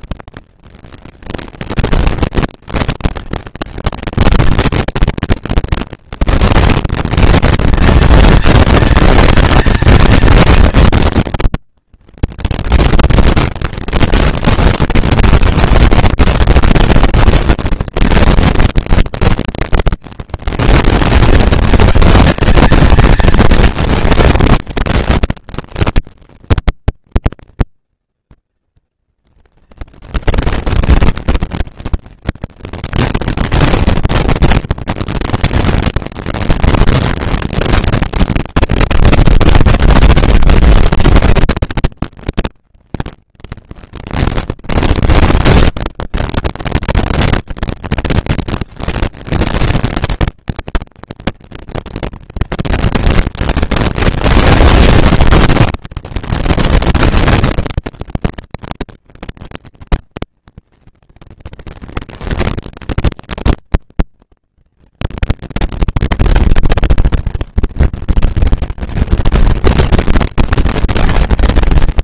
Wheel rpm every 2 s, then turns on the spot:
200, 220, 230, 230, 230, 230, 230, 230, 230, 230, 230, 230, 230, 230, 230, 230, 230, 230, 230, 230, 230, 200, 140, 150, 230, 230, 230, 230, 230, 230, 230, 240, 230, 230, 220, 220.
none